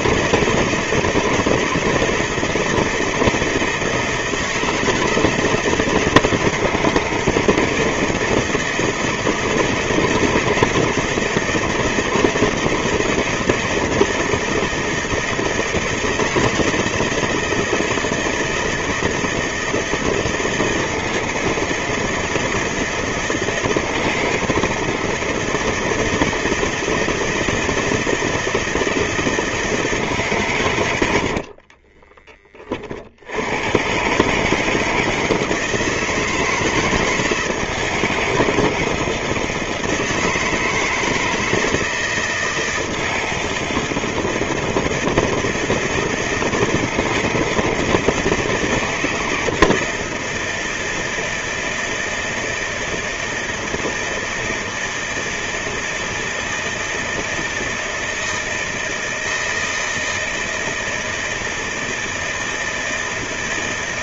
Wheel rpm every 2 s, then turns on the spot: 160, 170, 160, 160, 160, 170, 160, 160, 160, 160, 170, 160, 160, 160, 160, 150, 30, 150, 160, 160, 160, 160, 160, 160, 160, 160, 160, 160, 170, 160, 160, 160.
none